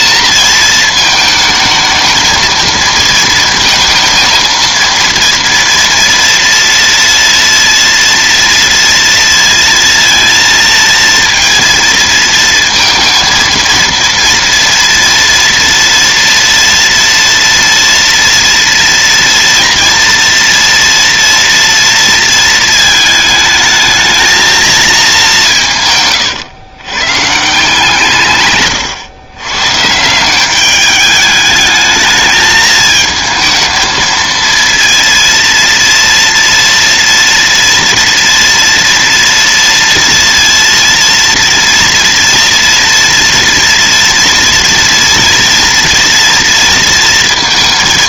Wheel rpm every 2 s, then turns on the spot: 230, 230, 230, 230, 230, 230, 230, 230, 230, 240, 230, 220, 220, 120, 120, 200, 220, 230, 230, 230, 230, 230, 230, 230.
28-30